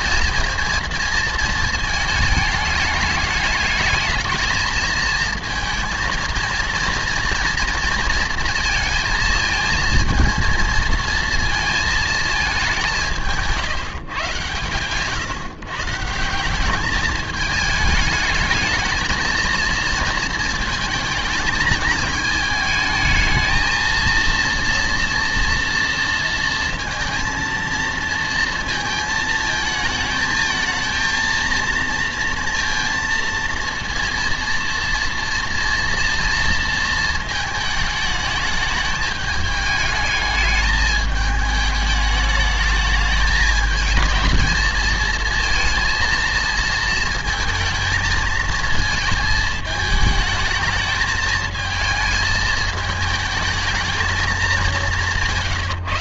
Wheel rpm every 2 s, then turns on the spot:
230, 210, 230, 230, 230, 230, 210, 120, 190, 210, 220, 220, 230, 230, 230, 220, 230, 230, 230, 210, 210, 210, 220, 230, 220, 220, 220, 190.
none